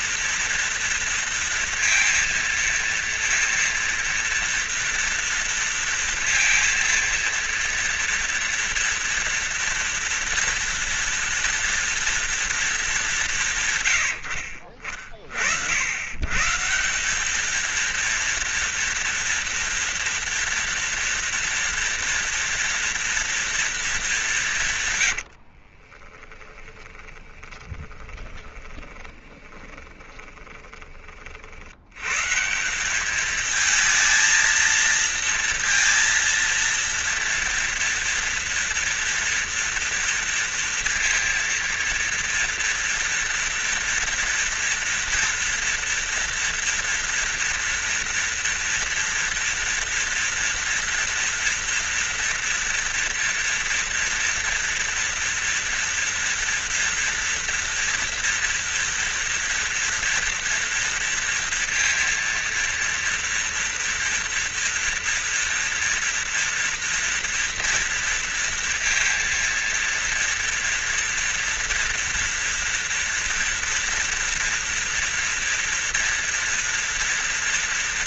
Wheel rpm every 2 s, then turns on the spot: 230, 230, 230, 230, 230, 240, 210, 40, 170, 230, 230, 230, 120, 20, 20, 30, 180, 230, 230, 230, 230, 230, 230, 230, 240, 230, 230, 230, 230, 230, 230, 230, 230, 230, 230, 230, 230, 240, 240.
26-30